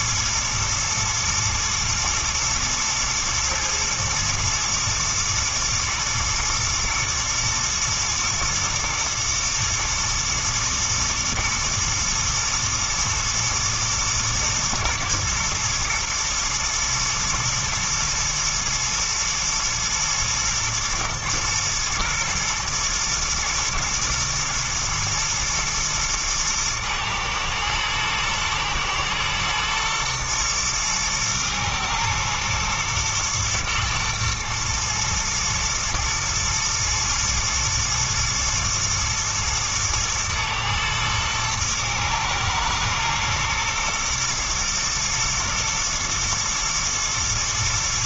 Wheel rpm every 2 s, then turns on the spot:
120, 110, 110, 120, 120, 110, 110, 110, 110, 120, 120, 110, 110, 110, 110, 110, 120, 120, 120, 110, 110, 110, 120, 120.
none